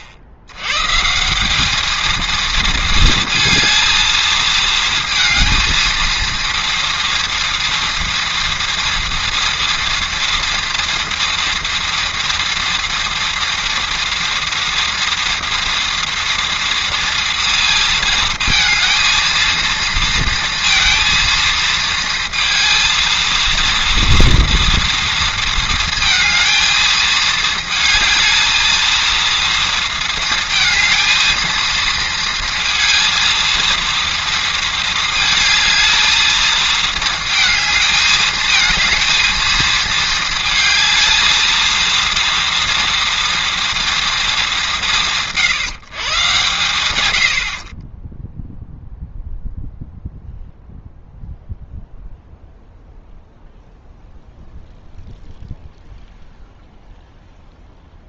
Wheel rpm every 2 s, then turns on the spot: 90, 230, 230, 230, 230, 230, 230, 230, 230, 220, 230, 230, 230, 220, 220, 230, 230, 230, 220, 220, 220, 230, 190, 120, 0, 0, 0, 0, 0.
none